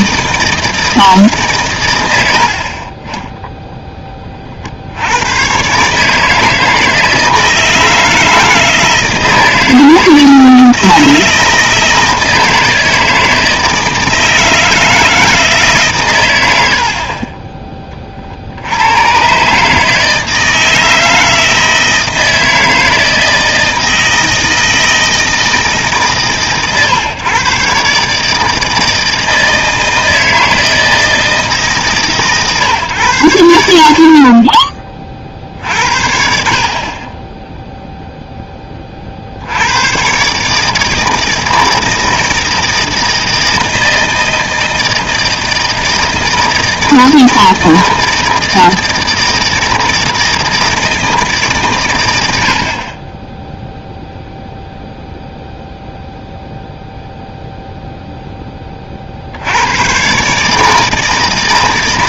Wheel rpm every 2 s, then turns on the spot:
160, 60, 50, 160, 160, 160, 160, 160, 80, 70, 160, 160, 160, 130, 160, 160, 140, 30, 50, 20, 150, 160, 160, 160, 160, 160, 70, 0, 0, 20, 150.
none